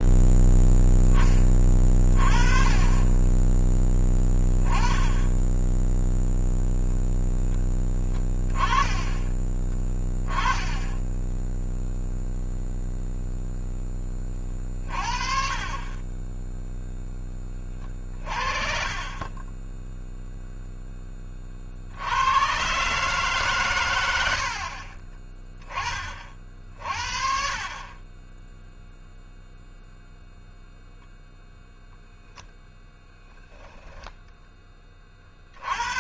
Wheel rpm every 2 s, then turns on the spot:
0, 30, 10, 0, 20, 20, 0, 40, 0, 40, 0, 120, 50, 40, 0, 0, 0, 20.
10-12 24-26